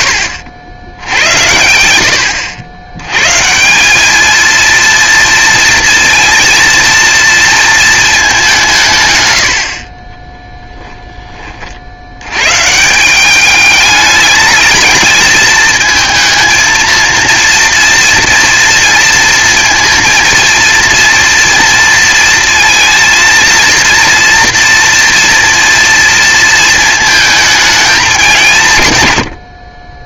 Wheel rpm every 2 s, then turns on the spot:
80, 100, 230, 230, 150, 10, 160, 220, 230, 230, 230, 230, 230, 220, 130.
none